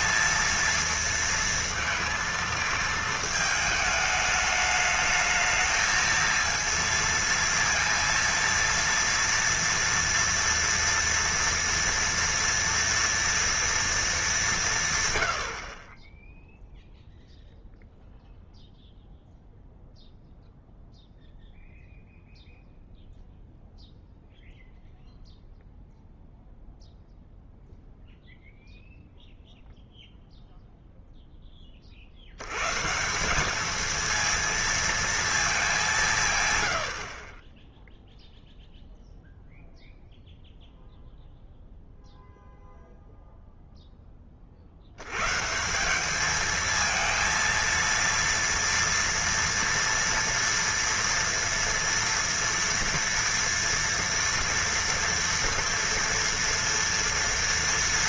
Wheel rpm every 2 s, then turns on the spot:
230, 220, 210, 230, 230, 230, 230, 170, 0, 0, 0, 0, 0, 0, 0, 0, 120, 230, 100, 0, 0, 0, 60, 220, 230, 230, 230, 230, 230.
none